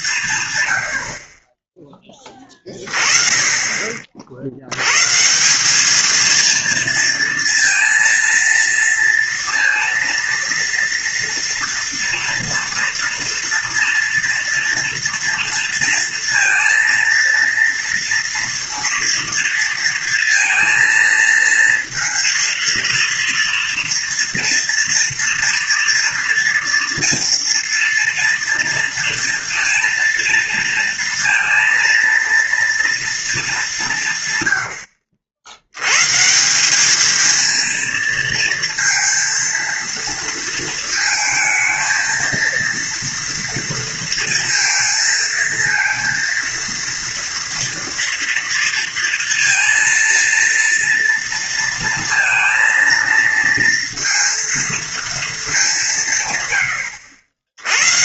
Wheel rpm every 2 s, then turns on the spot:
140, 20, 60, 230, 230, 230, 230, 230, 230, 230, 230, 230, 230, 240, 230, 230, 230, 120, 170, 230, 230, 230, 230, 230, 230, 230, 230, 230, 120.
none